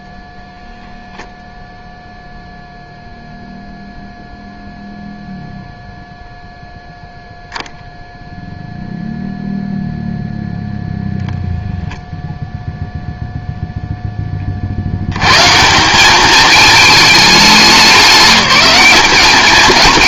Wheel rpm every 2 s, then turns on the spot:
0, 0, 0, 0, 0, 0, 0, 50, 220, 190.
none